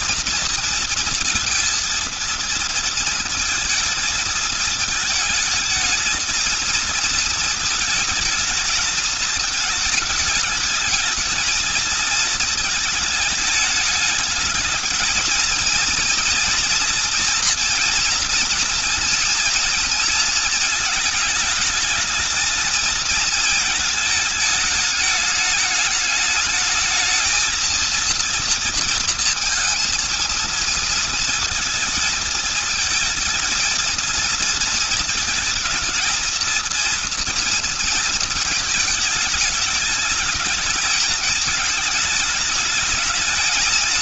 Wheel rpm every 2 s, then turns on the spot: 230, 230, 220, 220, 220, 210, 220, 220, 240, 230, 230, 220, 210, 220, 230, 230, 220, 230, 230, 230, 220, 220.
none